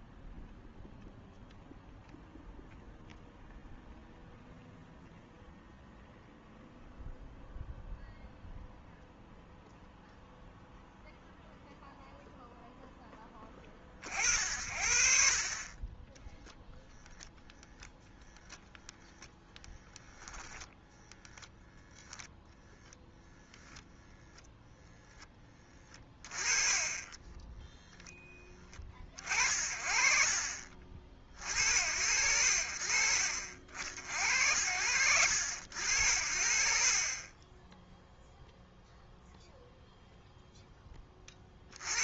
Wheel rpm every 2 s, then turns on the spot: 0, 0, 0, 0, 0, 0, 0, 60, 0, 0, 0, 0, 10, 40, 10, 50, 60, 70, 50, 0, 0.
none